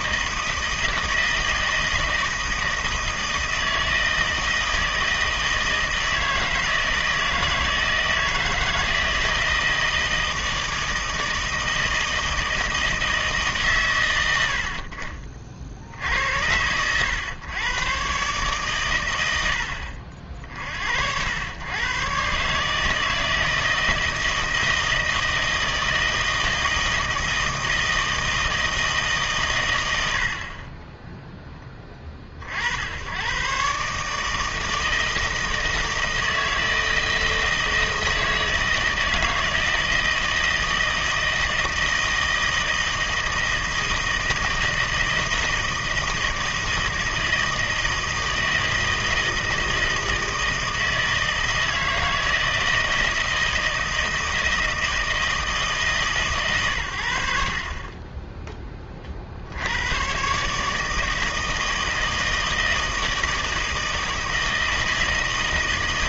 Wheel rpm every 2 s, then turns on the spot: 160, 160, 160, 160, 160, 160, 160, 60, 90, 130, 60, 140, 160, 160, 160, 40, 60, 160, 160, 160, 160, 160, 160, 160, 160, 160, 160, 160, 120, 20, 160, 160, 160.
30-32